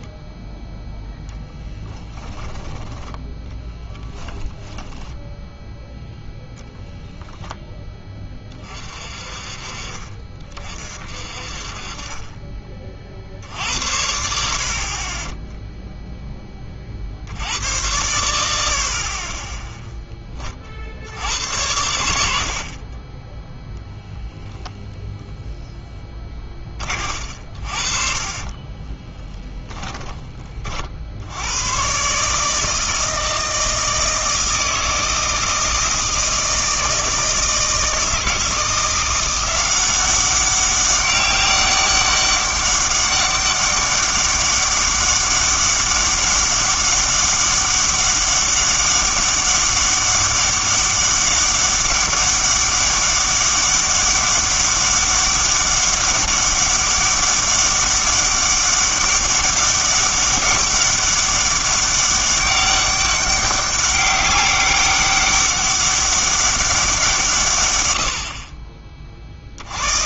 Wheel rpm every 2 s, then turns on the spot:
0, 10, 10, 0, 30, 40, 30, 60, 20, 70, 40, 40, 10, 30, 30, 40, 160, 160, 160, 170, 190, 200, 200, 200, 200, 200, 200, 200, 200, 200, 190, 200, 200, 190, 30.
4-6 28-30